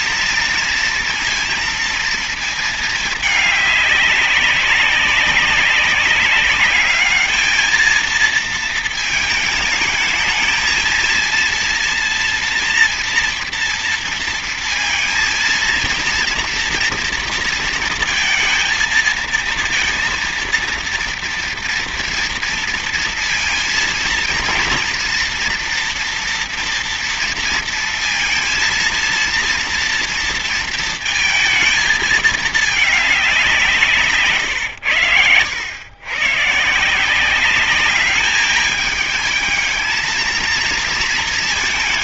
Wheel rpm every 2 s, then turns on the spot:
230, 220, 190, 200, 230, 220, 230, 230, 230, 220, 230, 230, 230, 240, 230, 230, 220, 120, 140, 210, 220.
none